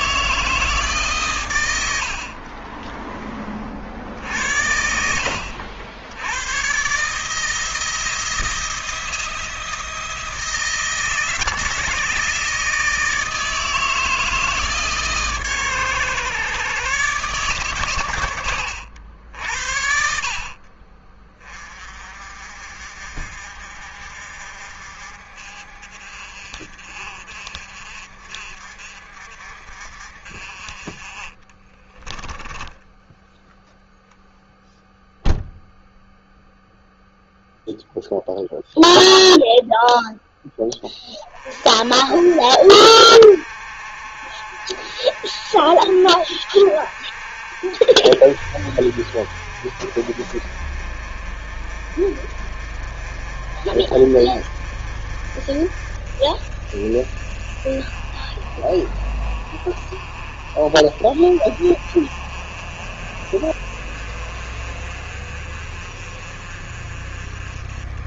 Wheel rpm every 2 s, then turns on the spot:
130, 20, 60, 160, 170, 160, 160, 140, 130, 80, 30, 50, 50, 50, 50, 30, 10, 0, 0, 0, 10, 60, 50, 50, 50, 40, 40, 40, 40, 40, 40, 40, 40, 40.
none